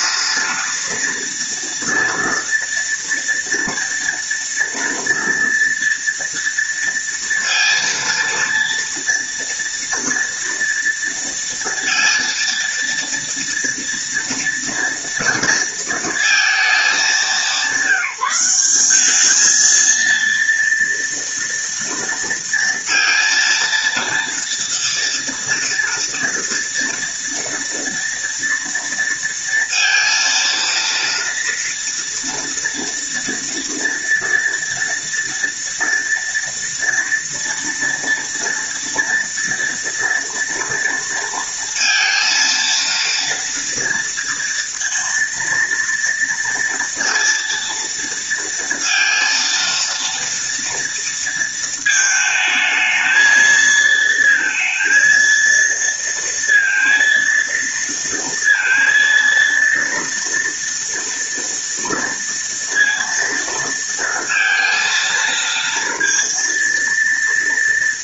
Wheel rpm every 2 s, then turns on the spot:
230, 230, 230, 230, 230, 230, 230, 230, 220, 190, 230, 230, 230, 230, 230, 230, 230, 230, 230, 230, 240, 230, 230, 230, 230, 230, 220, 230, 230, 230, 230, 230, 230, 230.
none